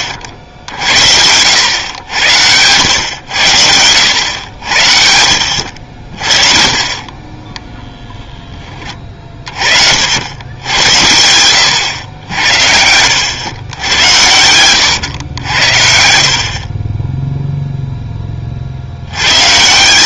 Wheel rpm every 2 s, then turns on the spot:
80, 100, 90, 40, 10, 90, 80, 110, 40, 40.
none